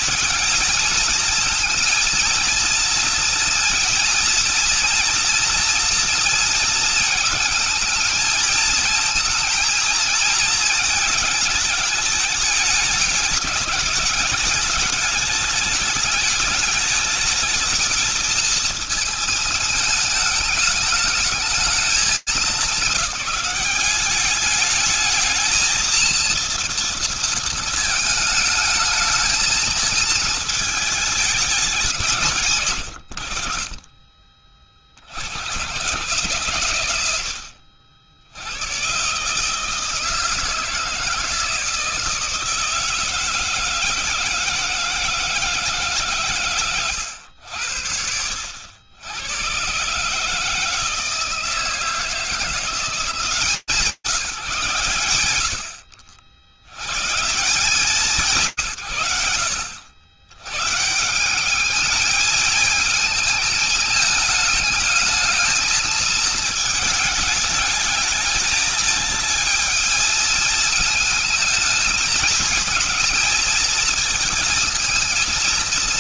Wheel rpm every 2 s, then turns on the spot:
220, 230, 240, 220, 220, 230, 210, 210, 210, 230, 210, 210, 210, 230, 220, 220, 120, 50, 100, 120, 160, 160, 160, 110, 80, 160, 160, 160, 70, 130, 120, 210, 210, 220, 220, 220, 220, 230.
none